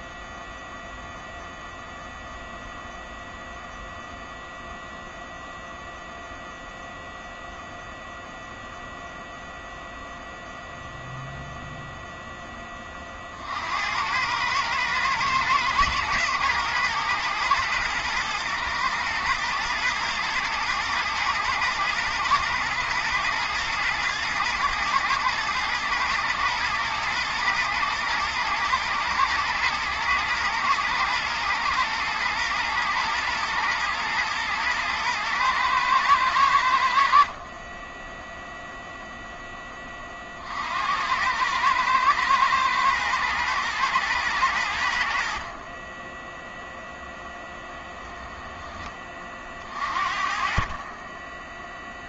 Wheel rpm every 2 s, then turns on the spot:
0, 0, 0, 0, 0, 0, 30, 110, 110, 120, 120, 110, 110, 110, 110, 120, 120, 110, 70, 0, 70, 110, 80, 0, 20, 40.
none